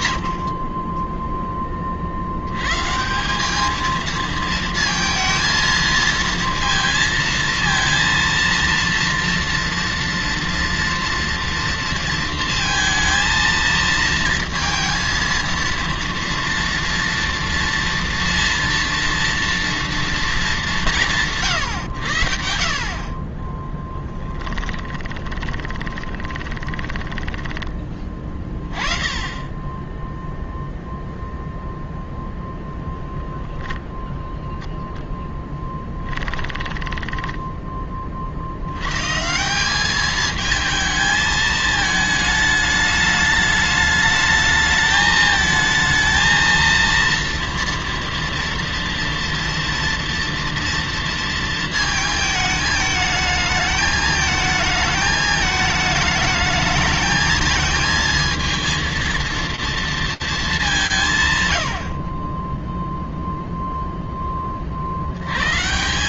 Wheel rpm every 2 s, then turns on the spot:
40, 120, 230, 230, 230, 230, 230, 230, 230, 230, 170, 50, 10, 20, 20, 0, 0, 0, 10, 120, 220, 210, 220, 230, 230, 230, 210, 220, 220, 230, 180, 0, 100.
24-28 36-38